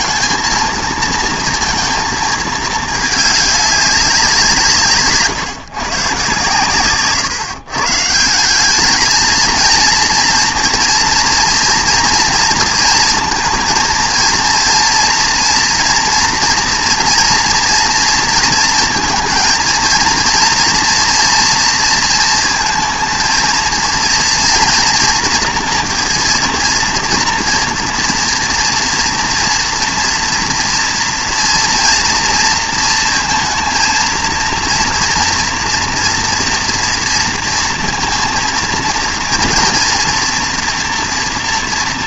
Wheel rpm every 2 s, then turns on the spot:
230, 220, 170, 140, 190, 230, 230, 230, 230, 230, 230, 230, 230, 230, 230, 230, 230, 230, 230, 230, 230.
none